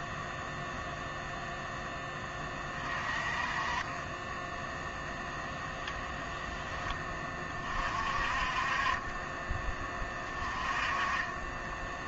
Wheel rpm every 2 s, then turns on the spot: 0, 30, 0, 10, 30, 20.
none